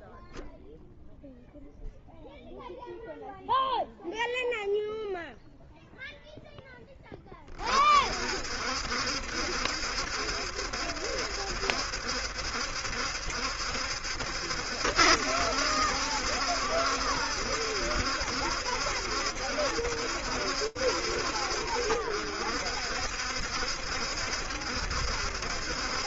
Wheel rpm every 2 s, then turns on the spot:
10, 0, 0, 10, 60, 70, 70, 70, 70, 70, 70, 60, 70.
none